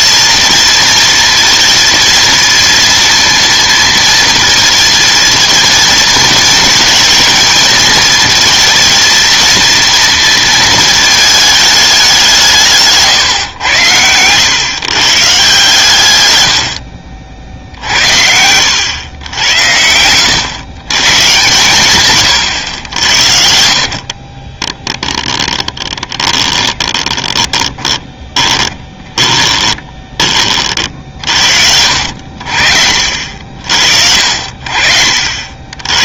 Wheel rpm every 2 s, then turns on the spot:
230, 230, 230, 220, 230, 220, 170, 130, 90, 90, 120, 100, 30, 20, 20, 40, 70, 60.
24-30